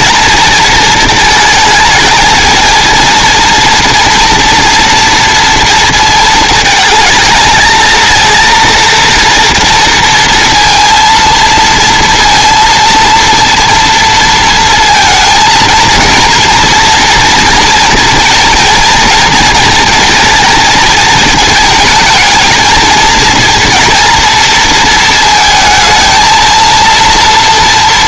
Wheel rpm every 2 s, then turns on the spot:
230, 230, 230, 220, 230, 230, 230, 230, 230, 230, 220, 230, 230, 230.
none